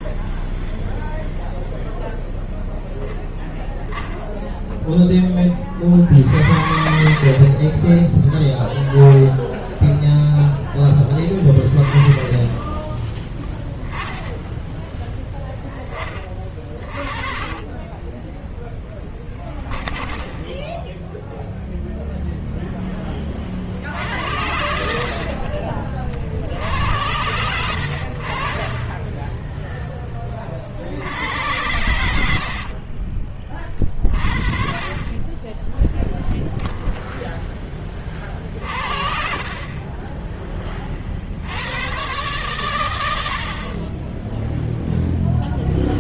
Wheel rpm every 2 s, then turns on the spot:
0, 0, 0, 50, 10, 0, 10, 10, 20, 0, 0, 0, 70, 50, 60, 30, 70, 40, 10, 50, 30, 120, 10.
6-8 14-18 38-40